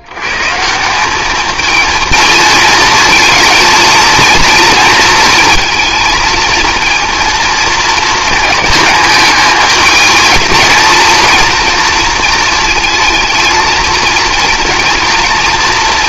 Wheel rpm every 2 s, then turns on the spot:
160, 230, 230, 230, 220, 220, 220, 230.
none